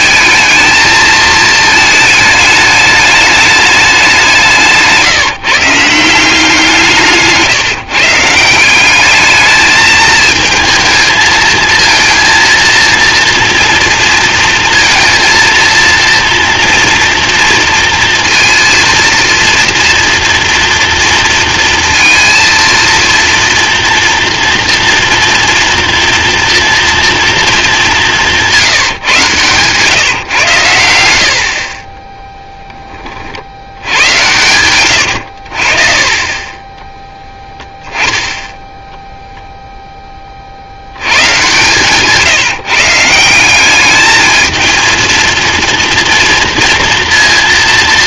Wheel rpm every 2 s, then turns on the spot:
220, 210, 170, 170, 180, 220, 230, 230, 240, 230, 230, 230, 230, 240, 160, 100, 20, 110, 20, 10, 60, 150, 220, 230.
34-36